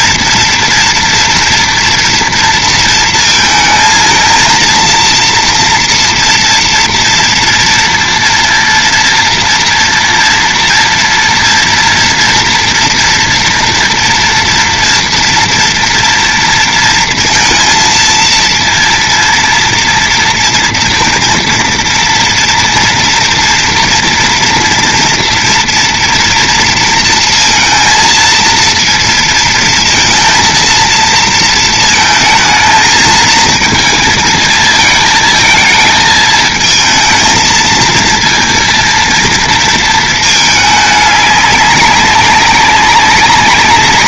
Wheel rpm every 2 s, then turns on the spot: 230, 230, 230, 230, 230, 230, 230, 230, 230, 230, 230, 230, 230, 230, 230, 230, 220, 220, 220, 230, 210, 190.
none